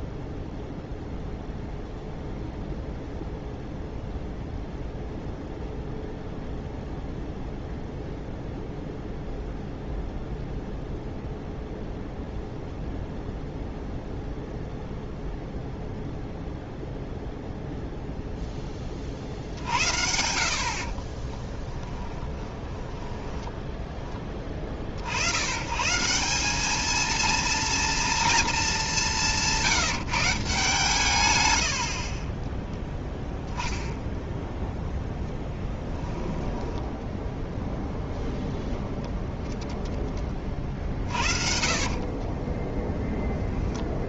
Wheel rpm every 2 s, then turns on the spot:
0, 0, 0, 0, 0, 0, 0, 0, 0, 20, 50, 20, 40, 210, 210, 150, 10, 0, 10, 0, 30, 10.
20-24 36-38 40-42